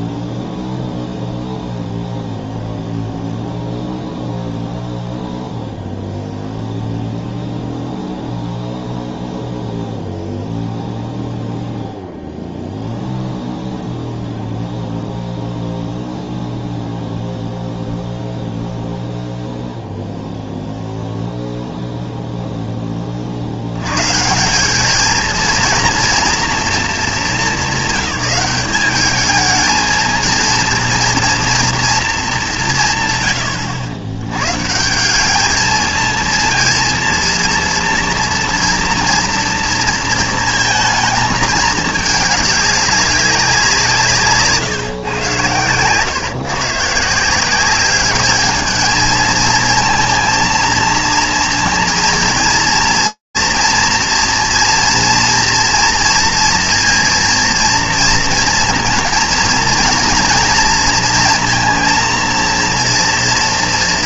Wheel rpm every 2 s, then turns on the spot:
0, 0, 0, 0, 0, 0, 0, 0, 0, 0, 0, 10, 190, 240, 190, 230, 180, 140, 230, 230, 220, 210, 150, 140, 220, 230, 230, 230, 230, 240, 230, 230.
none